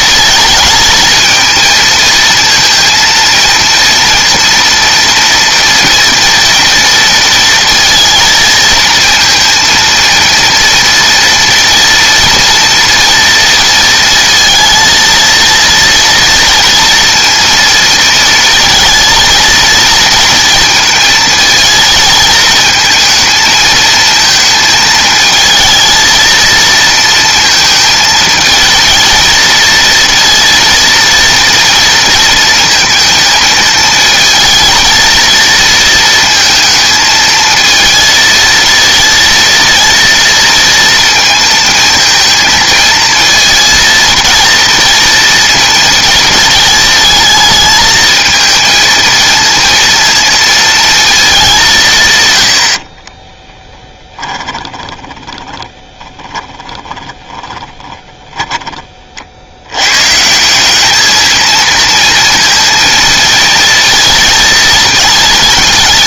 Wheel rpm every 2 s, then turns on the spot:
220, 230, 230, 230, 230, 230, 230, 230, 230, 220, 230, 220, 220, 230, 220, 230, 230, 220, 220, 230, 230, 230, 230, 220, 220, 230, 120, 20, 10, 10, 150, 230, 230.
54-60